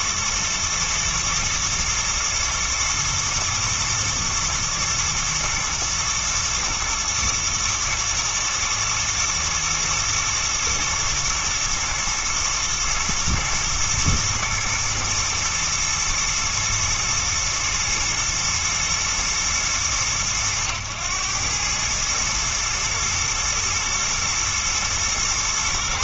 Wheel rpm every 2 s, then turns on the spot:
110, 110, 110, 120, 110, 110, 120, 110, 120, 120, 110, 110, 110.
none